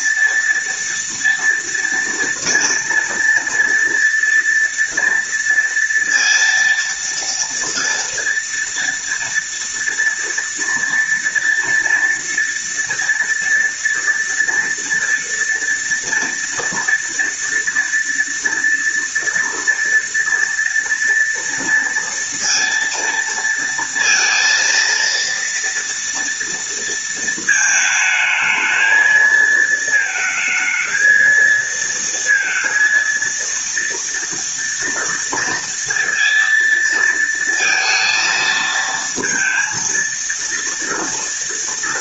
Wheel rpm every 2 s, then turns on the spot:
230, 230, 230, 230, 230, 230, 230, 240, 240, 230, 230, 230, 230, 230, 220, 220, 230, 230, 230, 230, 230.
none